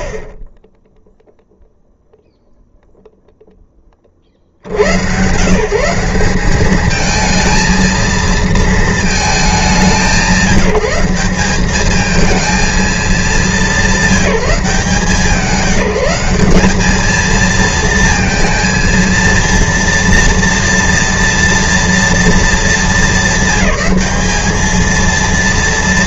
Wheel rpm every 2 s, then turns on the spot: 10, 0, 70, 200, 230, 190, 220, 180, 200, 230, 230, 210, 220.
none